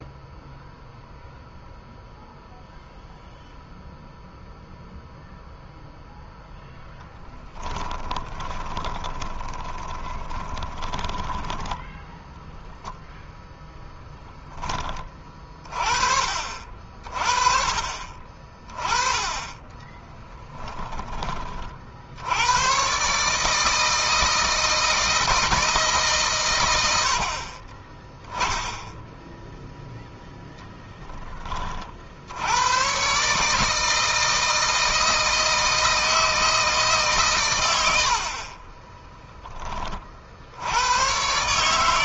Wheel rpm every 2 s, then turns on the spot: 0, 0, 0, 0, 20, 20, 0, 20, 40, 20, 10, 100, 160, 110, 10, 10, 100, 160, 160, 40, 80.
8-12